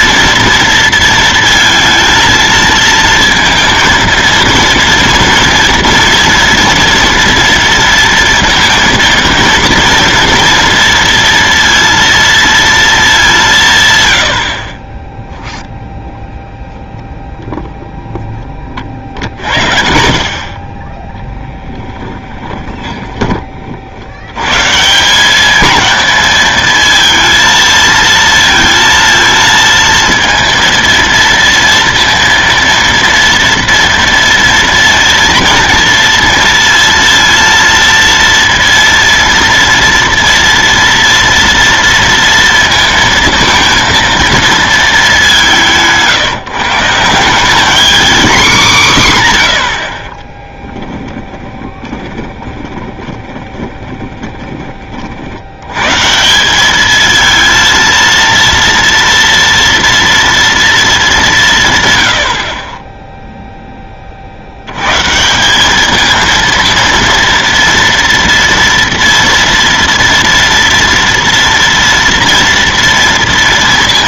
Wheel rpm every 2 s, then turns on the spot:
230, 230, 230, 240, 230, 230, 230, 40, 0, 30, 30, 20, 130, 220, 230, 230, 230, 230, 230, 230, 230, 230, 220, 150, 220, 20, 20, 20, 190, 230, 230, 40, 80, 230, 230, 230, 230.
20-24 50-54